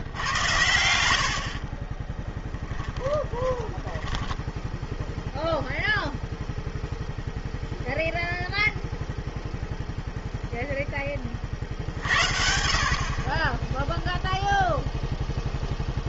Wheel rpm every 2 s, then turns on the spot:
80, 10, 10, 0, 0, 0, 50, 0.
2-6